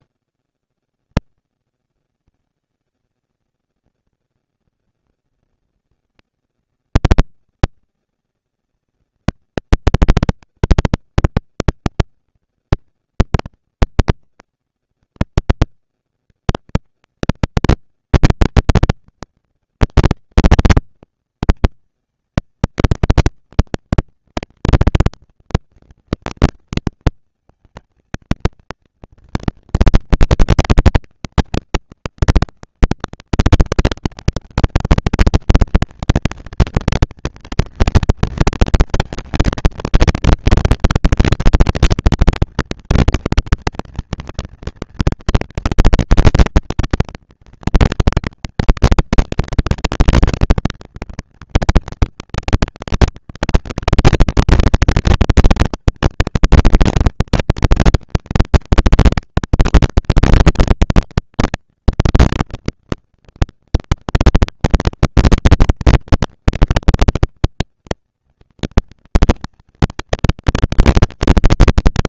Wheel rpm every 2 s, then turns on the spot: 160, 230, 230, 230, 230, 240, 230, 230, 230, 240, 230, 230, 230, 230, 220, 200, 190, 210, 230, 230, 240, 230, 230, 230, 230, 240, 230, 230, 230, 230, 240, 230, 230, 230, 230, 230.
none